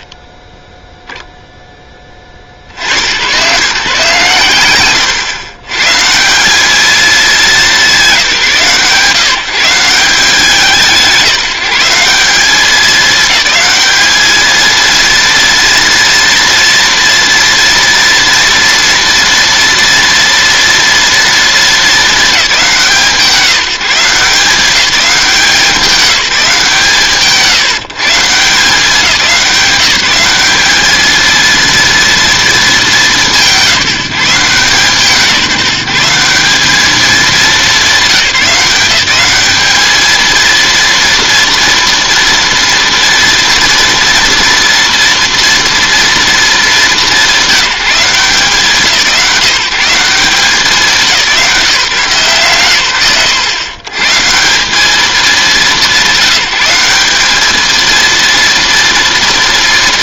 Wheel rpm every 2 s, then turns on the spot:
0, 90, 120, 220, 150, 170, 200, 230, 230, 240, 240, 180, 190, 150, 180, 210, 190, 160, 210, 200, 230, 230, 230, 200, 170, 180, 130, 200, 190, 210.
none